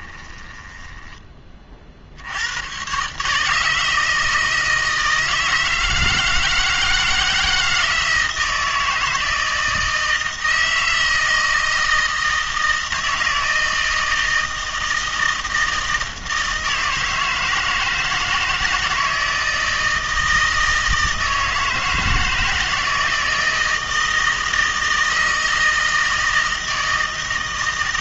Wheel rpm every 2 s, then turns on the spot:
10, 110, 160, 160, 160, 160, 160, 160, 160, 160, 160, 160, 160, 160.
0-2